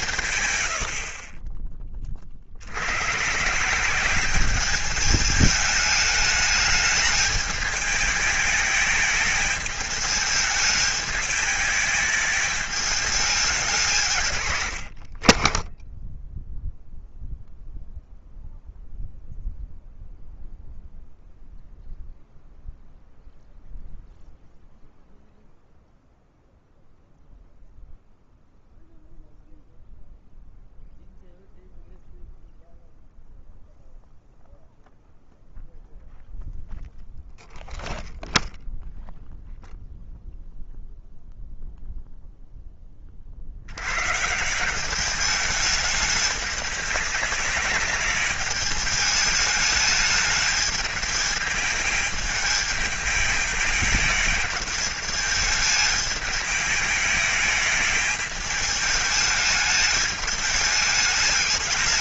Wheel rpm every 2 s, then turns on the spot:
70, 80, 200, 220, 210, 220, 210, 70, 0, 0, 0, 0, 0, 0, 0, 0, 0, 0, 0, 0, 0, 10, 190, 200, 210, 210, 210, 210, 220, 210, 210.
14-16